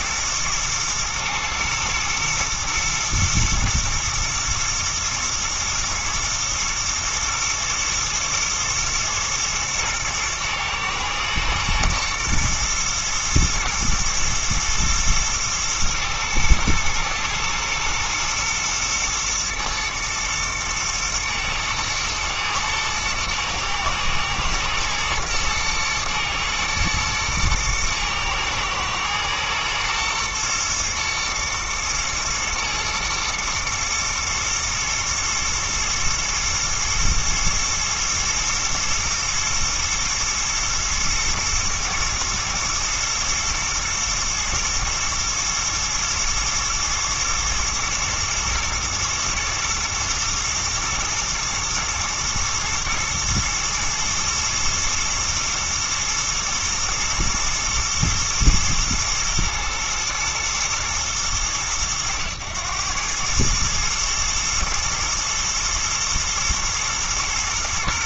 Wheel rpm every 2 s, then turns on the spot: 110, 110, 110, 110, 110, 110, 120, 110, 110, 110, 110, 110, 110, 110, 110, 120, 110, 120, 110, 110, 120, 110, 110, 110, 110, 120, 110, 120, 110, 110, 110, 100, 110, 110.
none